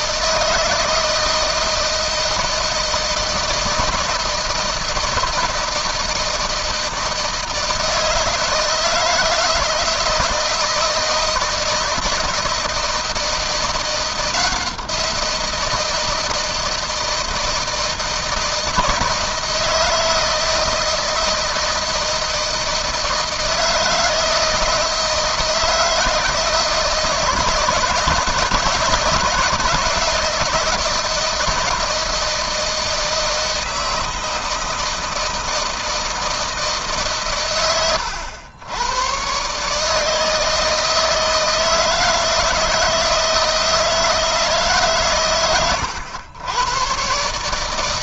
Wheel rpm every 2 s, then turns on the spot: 160, 160, 160, 160, 160, 160, 160, 170, 160, 160, 160, 160, 160, 160, 150, 170, 160, 160, 140, 110, 160, 160, 130, 120.
none